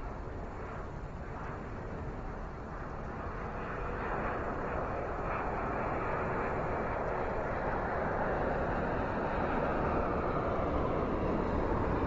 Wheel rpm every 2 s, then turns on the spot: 0, 0, 0, 0, 0, 0.
none